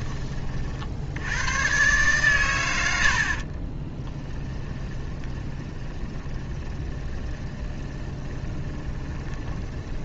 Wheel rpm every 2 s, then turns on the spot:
70, 90, 20, 20, 20.
4-10